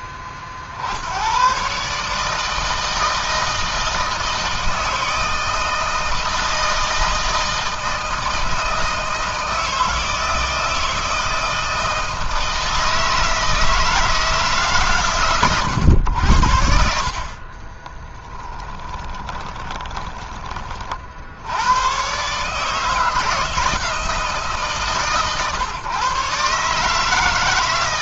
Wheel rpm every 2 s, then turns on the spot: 40, 160, 160, 160, 160, 160, 160, 130, 60, 10, 40, 150, 140, 140.
18-20